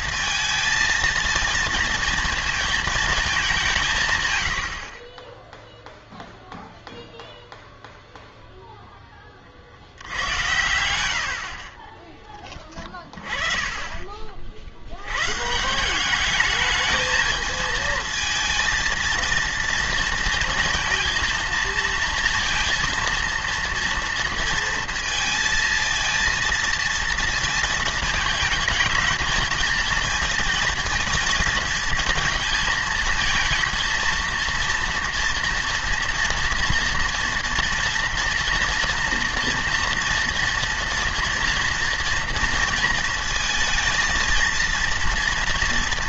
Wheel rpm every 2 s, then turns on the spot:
230, 230, 80, 0, 0, 100, 20, 60, 220, 230, 230, 230, 230, 230, 220, 230, 220, 230, 230, 230, 240, 230, 230.
4-6